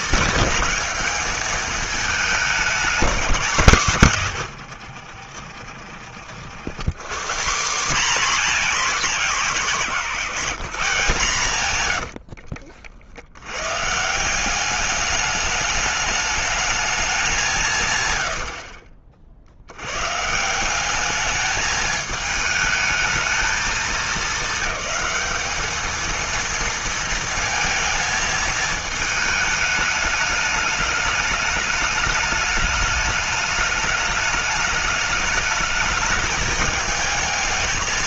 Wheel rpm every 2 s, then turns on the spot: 210, 210, 100, 110, 230, 170, 60, 190, 220, 70, 160, 220, 210, 230, 220, 210, 210, 210, 220.
12-14